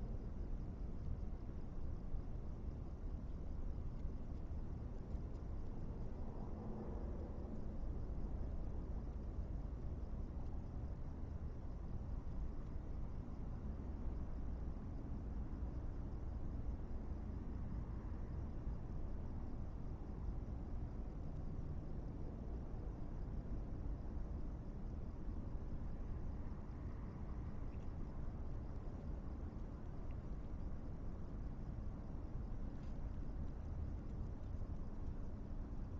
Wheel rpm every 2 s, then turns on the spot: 0, 0, 0, 0, 0, 0, 0, 0, 0, 0, 0, 0, 0, 0, 0, 0, 0, 0.
none